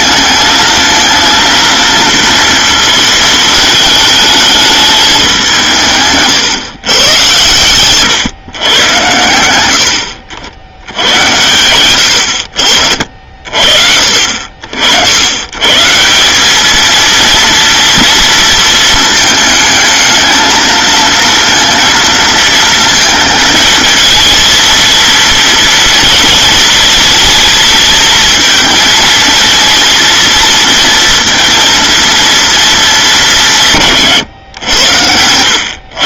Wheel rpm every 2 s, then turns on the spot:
230, 220, 200, 120, 100, 80, 50, 90, 230, 220, 230, 230, 230, 220, 230, 230, 200, 90.
none